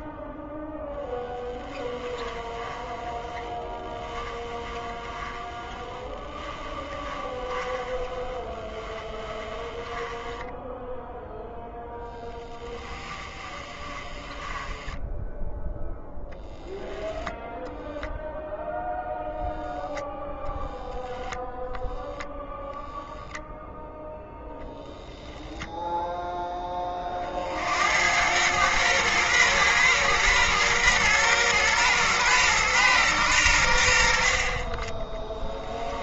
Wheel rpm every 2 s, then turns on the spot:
0, 10, 10, 10, 10, 0, 20, 10, 0, 0, 0, 0, 0, 30, 120, 120, 110, 20.
12-14 34-36